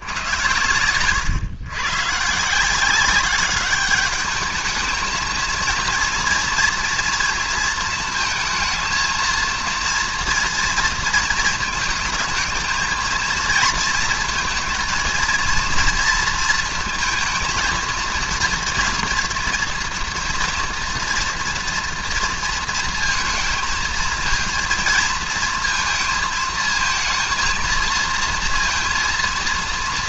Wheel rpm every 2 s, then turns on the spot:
120, 150, 210, 230, 230, 230, 220, 230, 230, 230, 230, 230, 220, 220, 230.
none